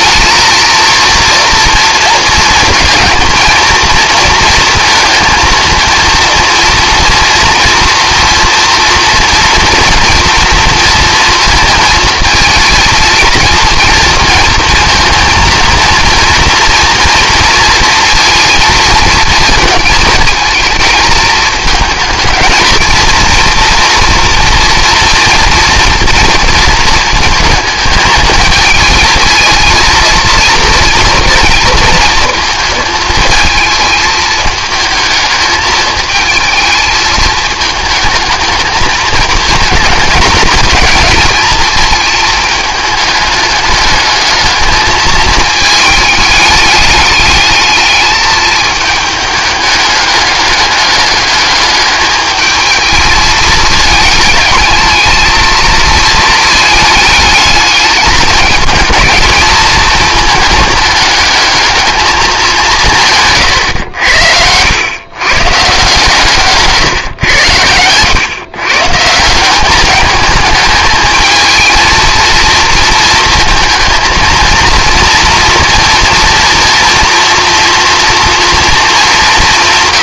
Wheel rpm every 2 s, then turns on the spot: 230, 220, 230, 240, 230, 230, 230, 220, 230, 230, 220, 230, 240, 230, 220, 230, 220, 220, 220, 220, 220, 220, 210, 210, 210, 200, 220, 220, 220, 220, 220, 200, 100, 130, 130, 210, 230, 230, 230, 230.
none